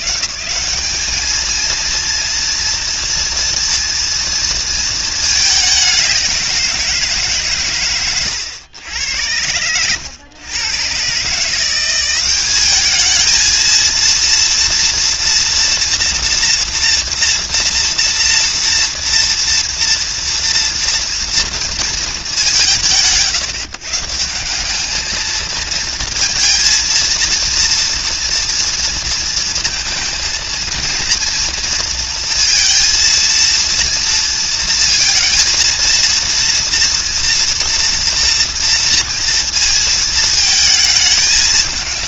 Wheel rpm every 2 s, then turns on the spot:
160, 230, 230, 180, 100, 110, 210, 230, 240, 230, 230, 160, 190, 230, 230, 230, 230, 230, 230, 230, 220.
none